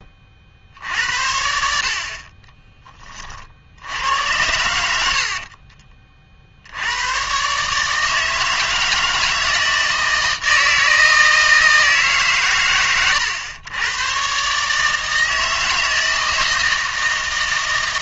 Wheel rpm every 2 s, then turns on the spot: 50, 30, 80, 70, 160, 160, 120, 140, 160.
2-4